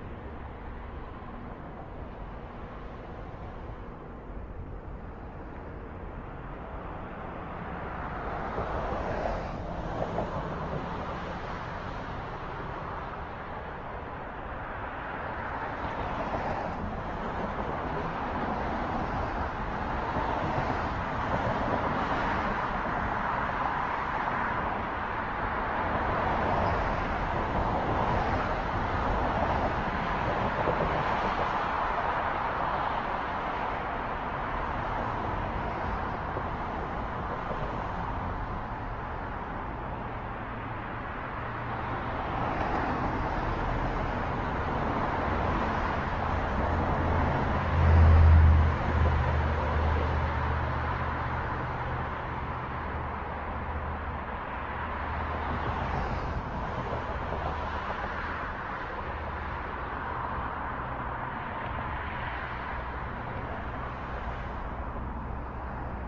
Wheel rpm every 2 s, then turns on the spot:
0, 0, 0, 0, 0, 0, 0, 0, 0, 0, 0, 0, 0, 0, 0, 0, 0, 0, 0, 0, 0, 0, 0, 0, 0, 0, 0, 0, 0, 0, 0, 0, 0.
none